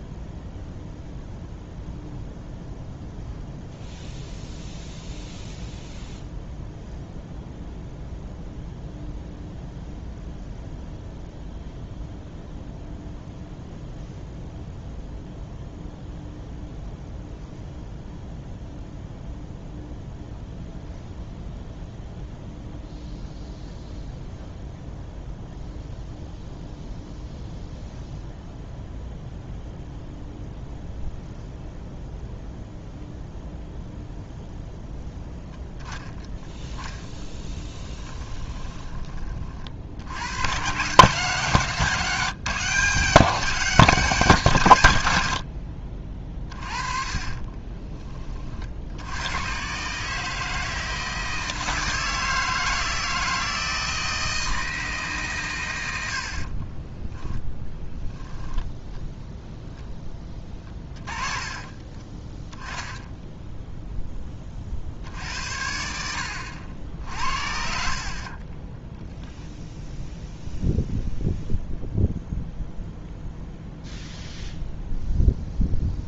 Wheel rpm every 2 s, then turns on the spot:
0, 0, 0, 0, 0, 0, 0, 0, 0, 0, 0, 0, 0, 0, 0, 0, 0, 0, 10, 20, 140, 180, 150, 30, 60, 160, 160, 160, 30, 10, 20, 10, 50, 70, 20, 0, 0, 0.
36-40 46-48 56-58 60-62